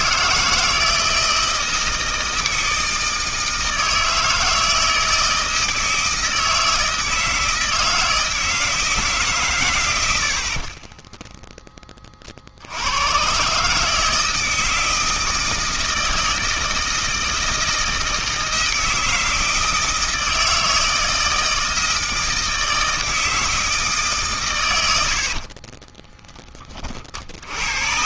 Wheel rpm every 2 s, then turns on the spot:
160, 160, 160, 160, 160, 30, 80, 160, 160, 160, 160, 160, 110, 30.
10-12